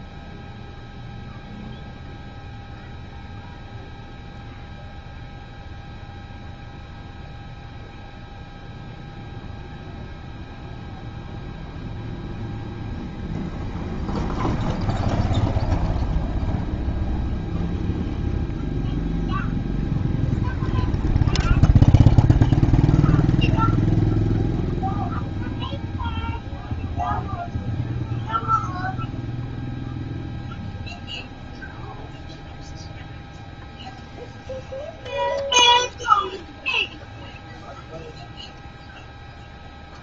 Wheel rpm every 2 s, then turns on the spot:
0, 0, 0, 0, 0, 0, 0, 0, 0, 0, 0, 0, 0, 0, 0, 0, 0, 0, 0, 0.
none